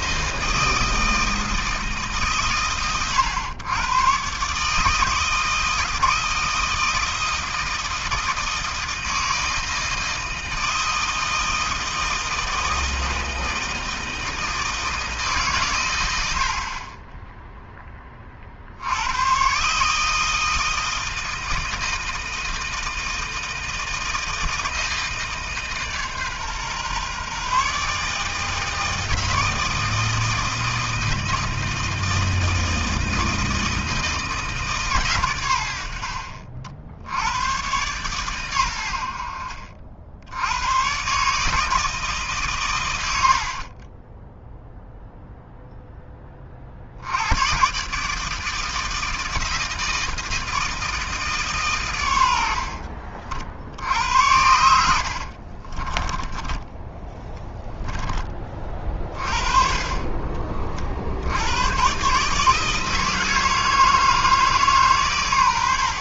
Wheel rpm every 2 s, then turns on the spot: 160, 130, 150, 160, 160, 160, 160, 160, 40, 70, 160, 160, 160, 140, 160, 160, 160, 150, 50, 100, 100, 120, 0, 50, 160, 160, 70, 90, 10, 40, 40, 160, 150.
52-56